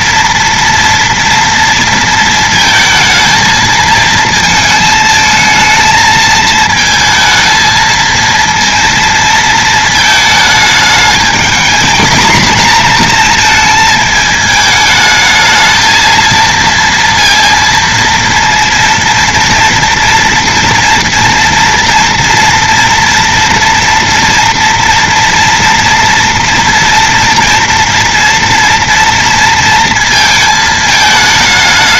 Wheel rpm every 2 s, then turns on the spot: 230, 220, 220, 220, 230, 220, 230, 220, 230, 230, 230, 240, 240, 240, 230, 220.
none